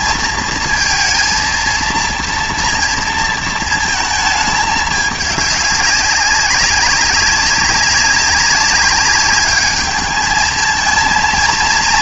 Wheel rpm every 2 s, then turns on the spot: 230, 230, 210, 200, 200, 220.
none